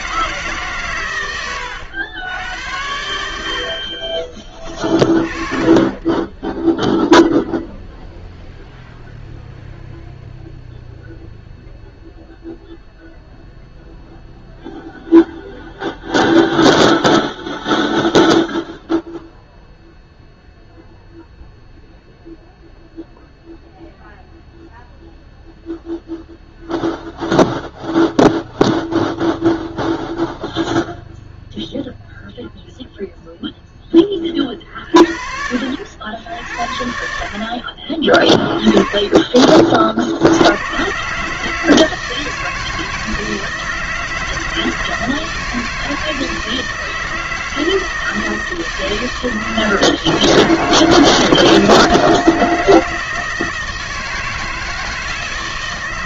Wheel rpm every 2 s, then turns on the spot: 140, 100, 30, 0, 0, 0, 0, 0, 0, 0, 0, 0, 0, 0, 0, 0, 0, 40, 70, 30, 110, 160, 160, 160, 160, 160, 160, 160.
none